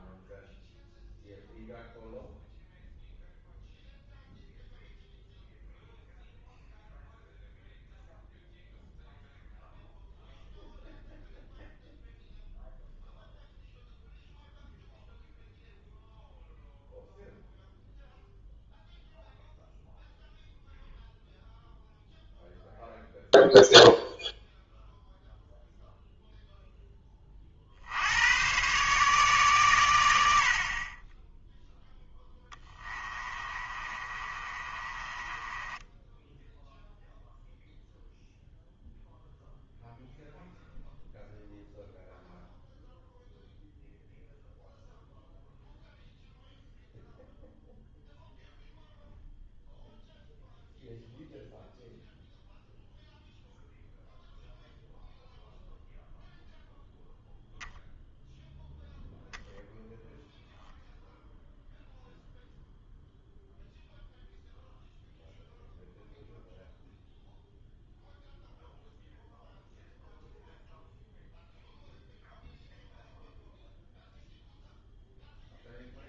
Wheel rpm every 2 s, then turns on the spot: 0, 0, 0, 0, 0, 0, 0, 0, 0, 0, 0, 0, 0, 0, 120, 50, 20, 30, 0, 0, 0, 0, 0, 0, 0, 0, 0, 0, 0, 0, 0, 0, 0, 0, 0, 0, 0, 0.
32-36